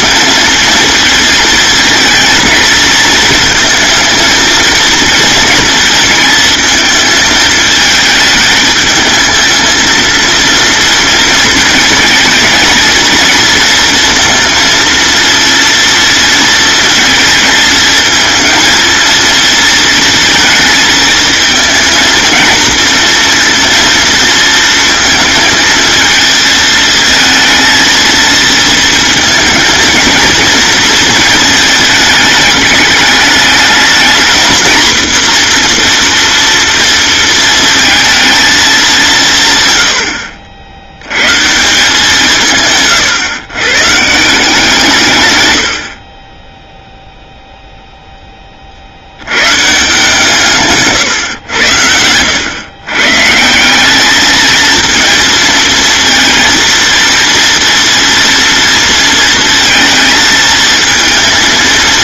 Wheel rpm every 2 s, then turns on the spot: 230, 220, 230, 220, 220, 230, 230, 230, 230, 230, 220, 230, 230, 220, 230, 230, 210, 240, 230, 200, 80, 120, 150, 0, 70, 140, 130, 220, 230, 230, 230.
none